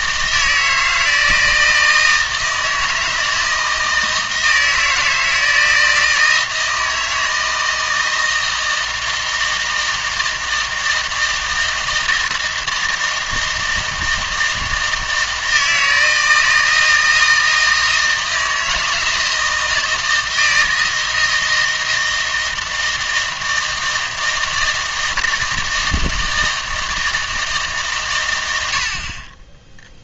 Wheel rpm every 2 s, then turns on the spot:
160, 160, 160, 160, 160, 160, 160, 160, 160, 160, 160, 160, 160, 160, 80.
none